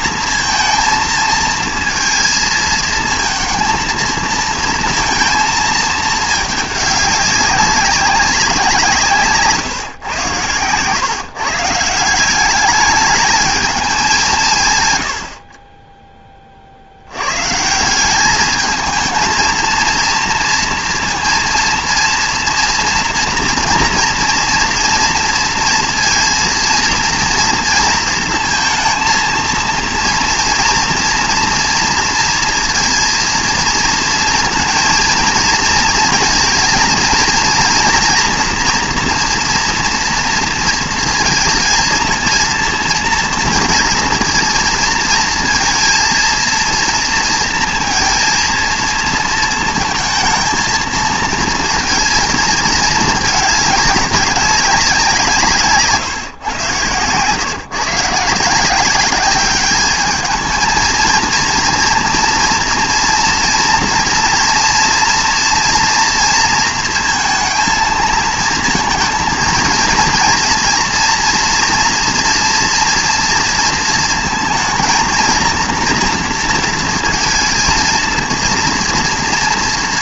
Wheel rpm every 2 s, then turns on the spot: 230, 220, 230, 210, 180, 120, 200, 140, 40, 220, 230, 240, 230, 230, 230, 230, 230, 230, 230, 240, 230, 230, 230, 230, 230, 230, 220, 190, 120, 170, 220, 230, 230, 230, 220, 230, 230, 220, 230, 230.
none